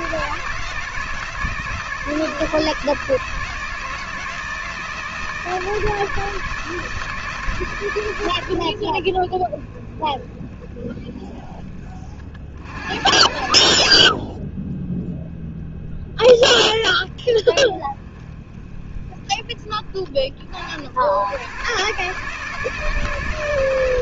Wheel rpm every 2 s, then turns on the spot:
160, 160, 160, 170, 60, 20, 70, 0, 10, 20, 70, 150.
none